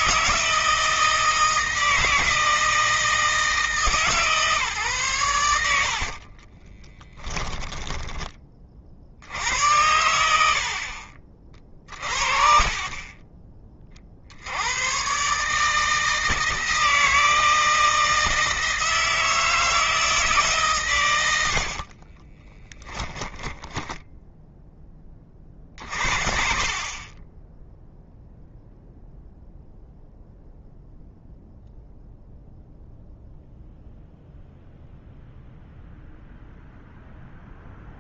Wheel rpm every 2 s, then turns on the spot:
160, 160, 120, 20, 60, 50, 30, 120, 160, 160, 130, 10, 20, 30, 0, 0, 0, 0, 0.
6-8 22-24